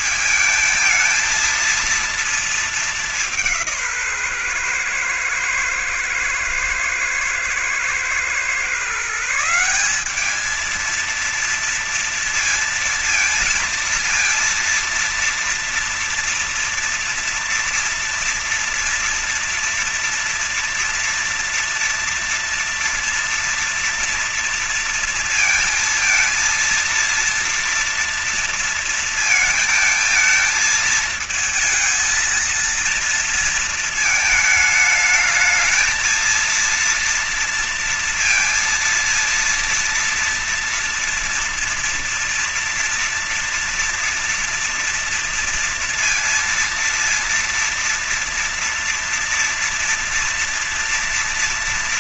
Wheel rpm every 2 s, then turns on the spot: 220, 220, 140, 110, 120, 200, 230, 230, 230, 230, 230, 230, 230, 230, 230, 220, 230, 220, 220, 230, 230, 230, 230, 230, 240, 230.
none